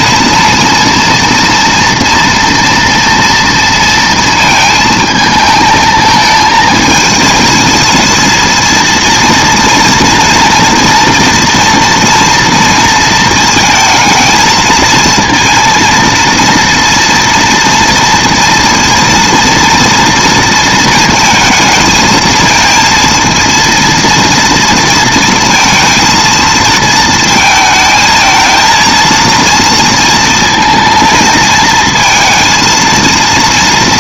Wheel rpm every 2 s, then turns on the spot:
230, 230, 220, 220, 230, 230, 230, 230, 230, 230, 220, 230, 230, 220, 230, 230, 230.
none